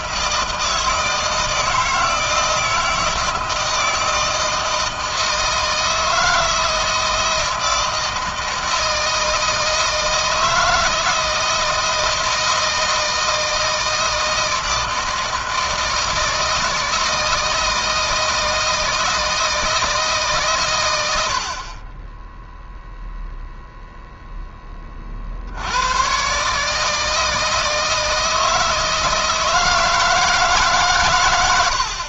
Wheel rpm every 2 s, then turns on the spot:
160, 160, 160, 170, 160, 160, 160, 160, 160, 160, 100, 0, 30, 150, 160, 140.
none